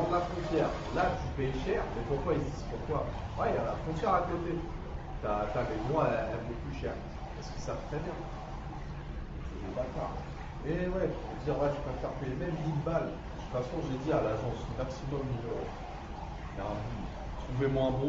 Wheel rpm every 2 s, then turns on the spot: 0, 0, 0, 0, 0, 0, 0, 0, 0.
none